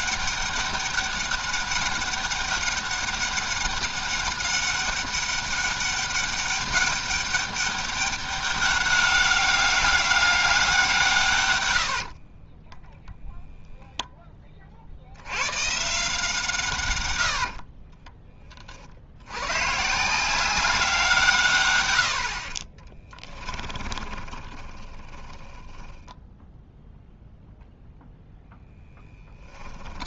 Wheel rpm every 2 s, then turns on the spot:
200, 200, 200, 200, 200, 180, 10, 50, 130, 40, 180, 30, 20, 0, 0.
12-14 22-26